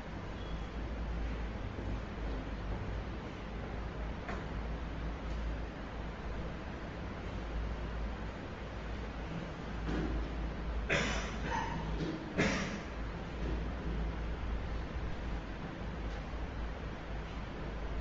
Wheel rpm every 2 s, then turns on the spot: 0, 0, 0, 0, 0, 0, 0, 0, 0.
none